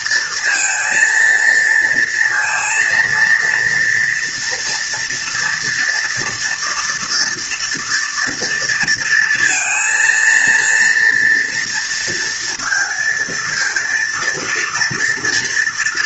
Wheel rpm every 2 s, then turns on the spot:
230, 230, 240, 240, 230, 230, 230, 230.
none